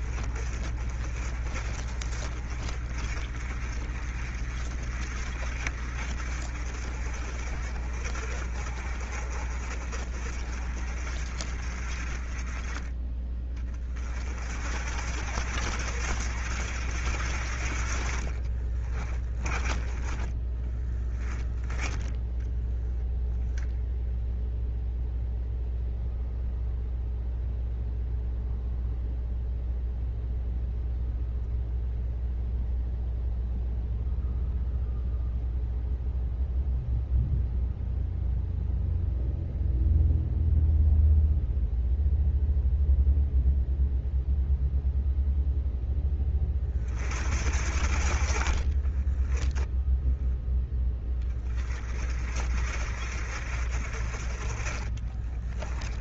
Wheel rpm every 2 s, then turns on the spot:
40, 40, 40, 50, 40, 40, 20, 60, 70, 30, 10, 10, 0, 0, 0, 0, 0, 0, 0, 0, 0, 0, 0, 40, 20, 10, 50, 30.
18-20 48-50 54-56